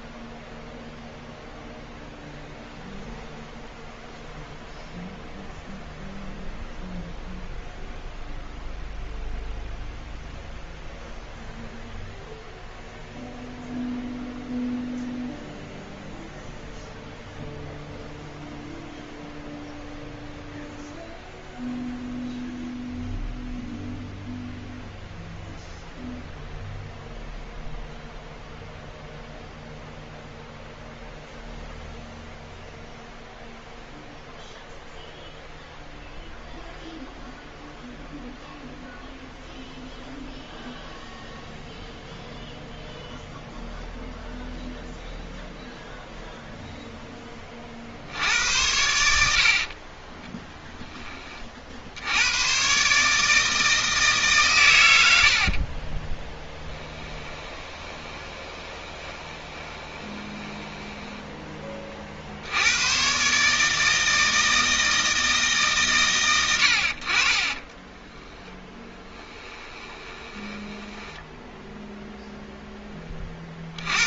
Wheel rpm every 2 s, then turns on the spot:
0, 0, 0, 0, 0, 0, 0, 0, 0, 0, 0, 0, 0, 0, 0, 0, 0, 0, 0, 0, 0, 0, 0, 0, 90, 10, 130, 100, 10, 20, 10, 100, 160, 70, 10, 10, 10.
56-62 68-72